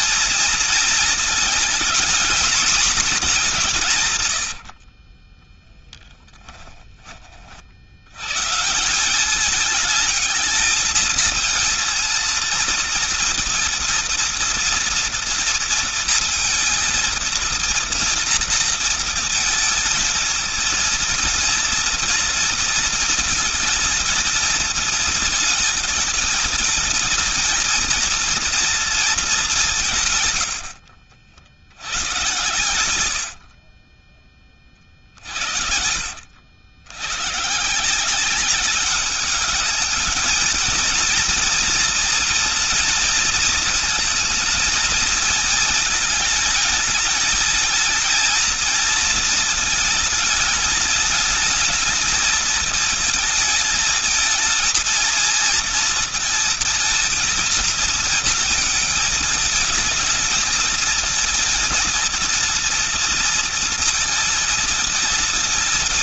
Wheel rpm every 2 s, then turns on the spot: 220, 220, 70, 20, 160, 220, 230, 230, 230, 230, 230, 230, 220, 220, 230, 70, 110, 40, 90, 200, 220, 230, 230, 220, 230, 220, 220, 230, 230, 220, 220, 230, 230.
4-6 30-34